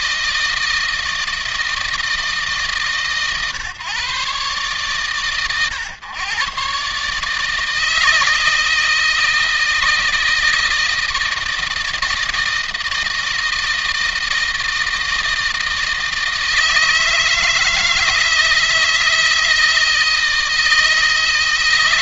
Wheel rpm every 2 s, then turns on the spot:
160, 140, 120, 140, 160, 160, 160, 160, 160, 160, 160.
none